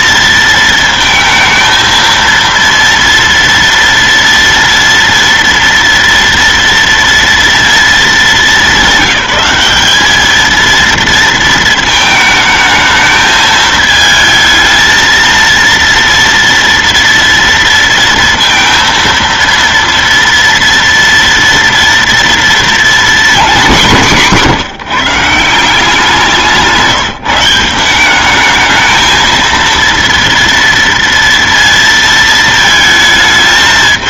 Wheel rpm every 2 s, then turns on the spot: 230, 230, 230, 230, 210, 220, 220, 220, 230, 230, 240, 230, 170, 180, 200, 230, 230.
none